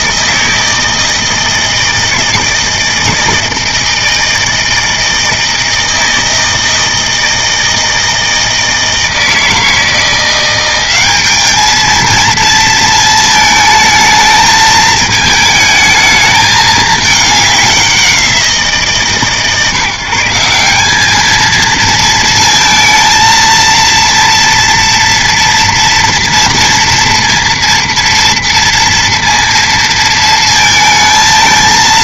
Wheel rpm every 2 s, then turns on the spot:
160, 160, 160, 160, 160, 180, 230, 220, 220, 170, 190, 230, 230, 230, 230, 230.
none